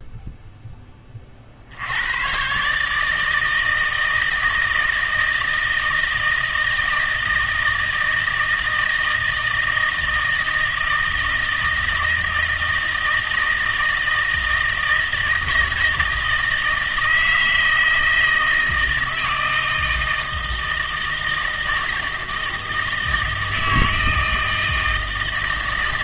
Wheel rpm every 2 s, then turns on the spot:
10, 140, 160, 160, 160, 160, 160, 160, 160, 160, 160, 160, 160.
none